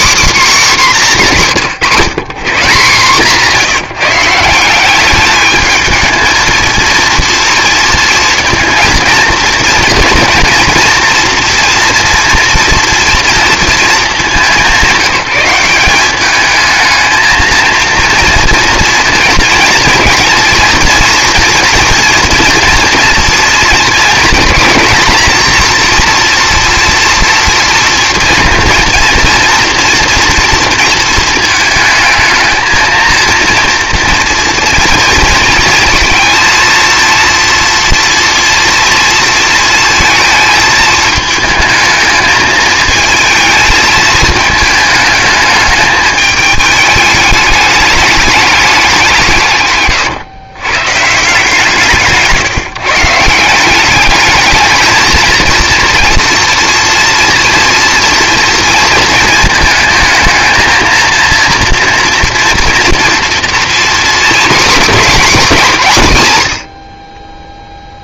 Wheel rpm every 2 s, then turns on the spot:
170, 170, 210, 230, 230, 230, 230, 170, 220, 230, 240, 240, 240, 240, 230, 230, 230, 230, 230, 230, 220, 220, 210, 210, 170, 150, 160, 220, 230, 230, 230, 240, 260, 40.
none